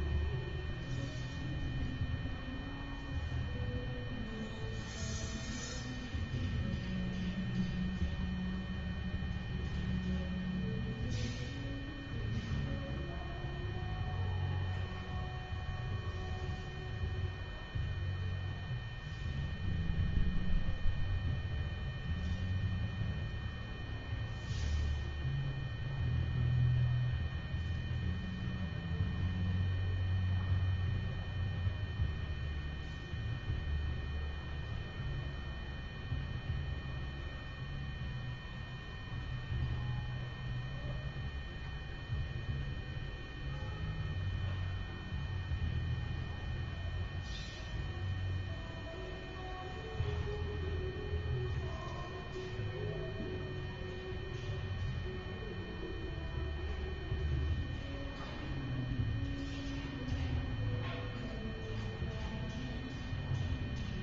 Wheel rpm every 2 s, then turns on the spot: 0, 0, 0, 0, 0, 0, 0, 0, 0, 0, 0, 0, 0, 0, 0, 0, 0, 0, 0, 0, 0, 0, 0, 0, 0, 0, 0, 0, 0, 0, 0, 0.
none